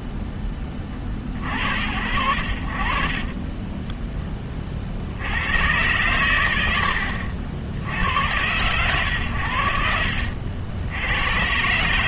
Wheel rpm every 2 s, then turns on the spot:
10, 50, 40, 100, 100, 80.
none